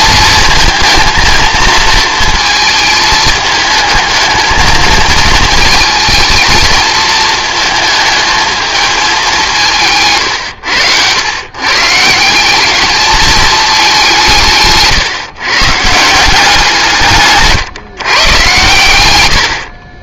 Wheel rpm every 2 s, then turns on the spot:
220, 220, 220, 220, 220, 110, 210, 140, 160, 100.
none